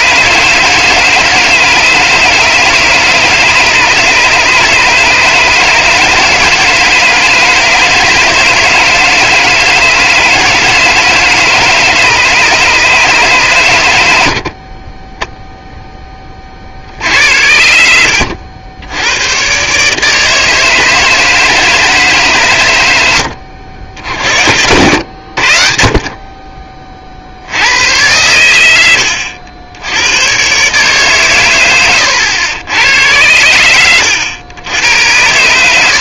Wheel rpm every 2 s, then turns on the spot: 160, 150, 150, 160, 160, 160, 150, 40, 50, 90, 150, 110, 80, 30, 100, 140, 100, 100.
none